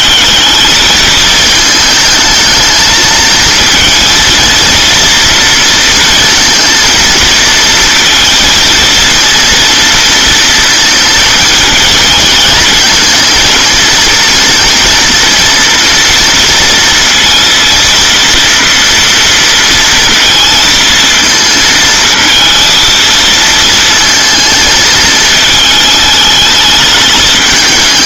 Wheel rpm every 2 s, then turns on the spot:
210, 220, 230, 230, 230, 230, 220, 230, 230, 230, 230, 230, 220, 210.
none